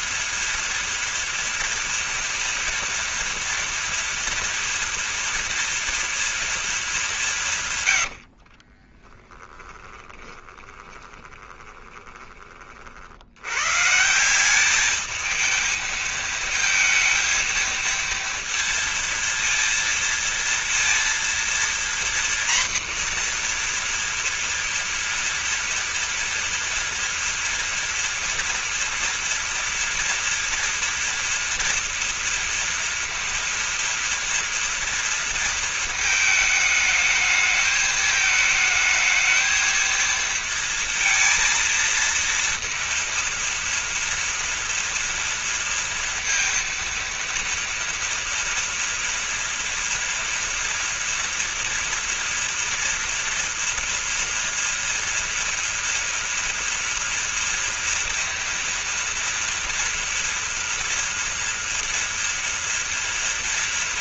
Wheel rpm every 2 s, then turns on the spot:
240, 230, 240, 210, 30, 20, 50, 210, 230, 230, 230, 240, 230, 230, 230, 230, 230, 230, 220, 220, 230, 230, 230, 230, 230, 230, 230, 230, 230, 230, 230, 230.
8-12